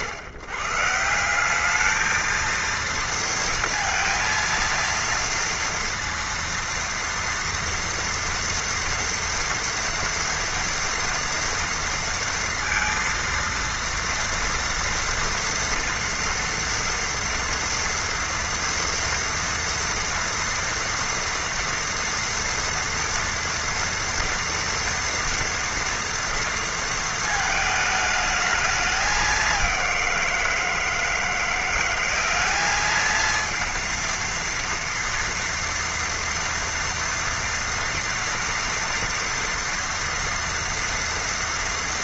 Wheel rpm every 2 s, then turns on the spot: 90, 230, 230, 230, 230, 230, 230, 230, 230, 230, 230, 230, 230, 230, 210, 170, 210, 230, 240, 230, 230.
none